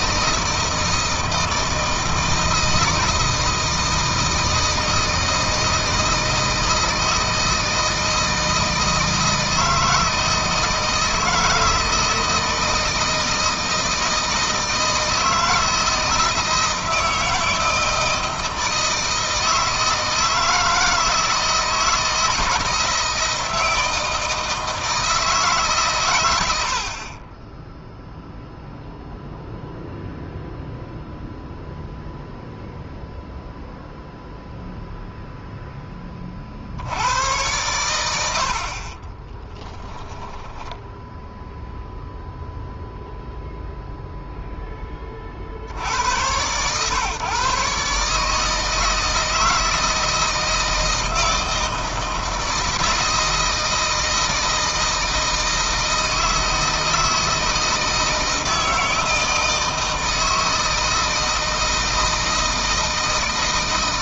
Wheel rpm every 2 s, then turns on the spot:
160, 160, 160, 160, 160, 160, 160, 160, 160, 160, 160, 160, 160, 80, 0, 0, 0, 0, 80, 60, 10, 0, 10, 120, 160, 160, 170, 160, 160, 160, 160, 160.
38-42